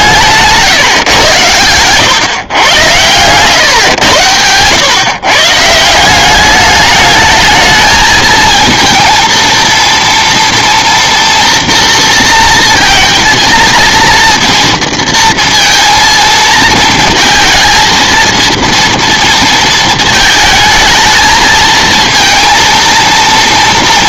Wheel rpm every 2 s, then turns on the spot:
150, 130, 110, 200, 230, 230, 230, 230, 220, 230, 220, 230.
none